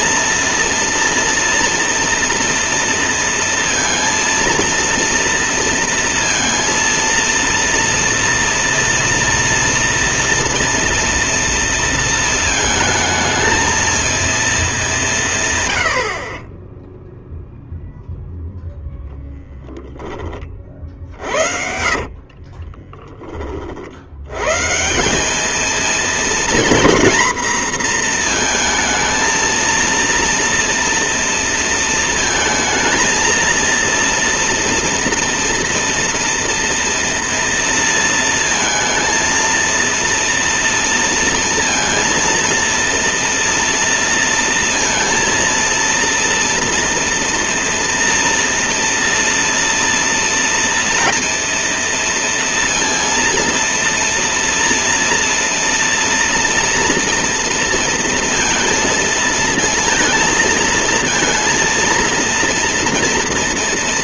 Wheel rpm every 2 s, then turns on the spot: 230, 230, 230, 230, 230, 230, 220, 200, 10, 0, 40, 20, 160, 230, 230, 230, 220, 230, 230, 230, 230, 230, 230, 230, 230, 230, 230, 230, 230, 230, 230, 230.
20-24